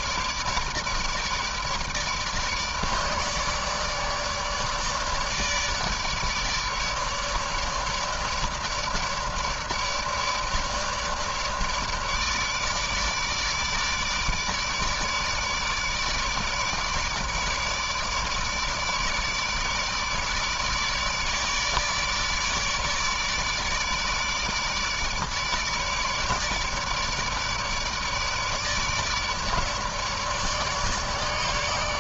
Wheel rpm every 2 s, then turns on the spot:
150, 150, 150, 150, 150, 150, 150, 150, 150, 150, 150, 150, 150, 150, 150, 150.
none